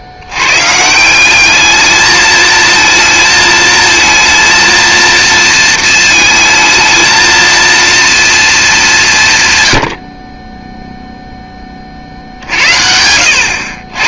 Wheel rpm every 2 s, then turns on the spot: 150, 220, 230, 220, 210, 10, 70.
none